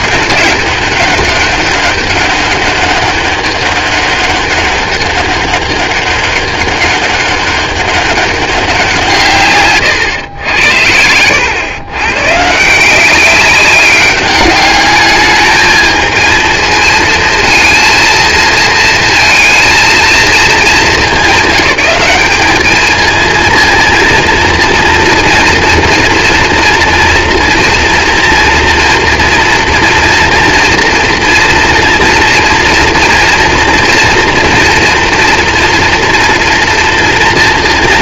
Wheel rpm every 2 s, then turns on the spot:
200, 200, 200, 200, 200, 100, 150, 200, 220, 230, 220, 210, 230, 230, 230, 230, 230, 230, 240.
10-12